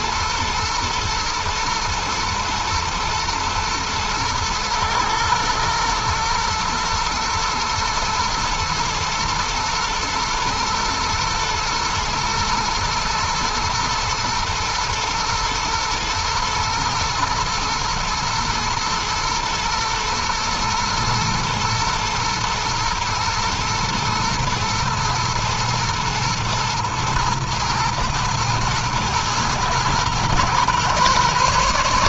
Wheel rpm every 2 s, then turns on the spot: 110, 120, 110, 120, 120, 120, 110, 110, 120, 120, 120, 120, 110, 110, 110, 120.
none